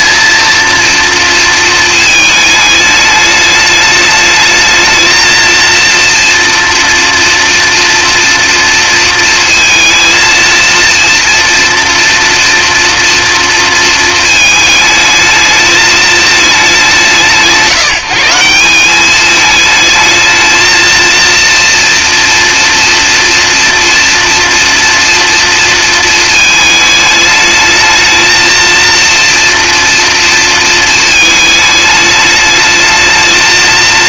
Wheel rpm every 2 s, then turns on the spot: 240, 210, 220, 230, 230, 230, 230, 220, 180, 190, 230, 230, 230, 220, 230, 220, 220.
none